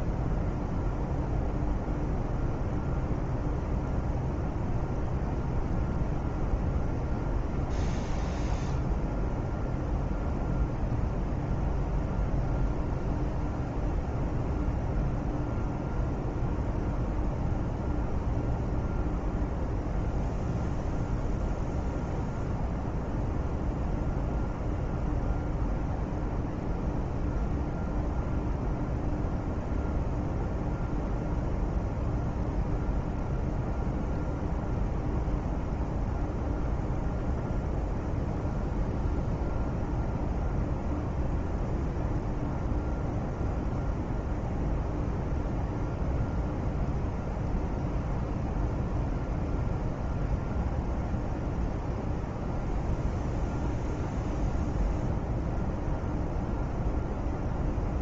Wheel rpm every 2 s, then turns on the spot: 0, 0, 0, 0, 0, 0, 0, 0, 0, 0, 0, 0, 0, 0, 0, 0, 0, 0, 0, 0, 0, 0, 0, 0, 0, 0, 0, 0, 0.
none